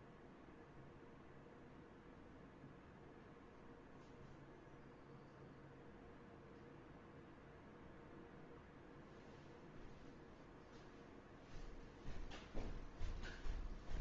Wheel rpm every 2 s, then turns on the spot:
0, 0, 0, 0, 0, 0, 0.
none